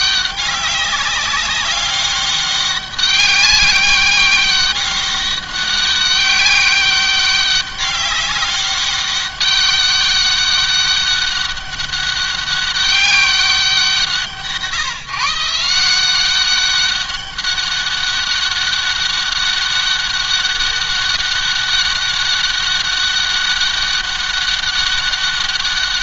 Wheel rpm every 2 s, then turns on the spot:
200, 200, 200, 200, 200, 200, 200, 150, 190, 200, 200, 200, 200.
none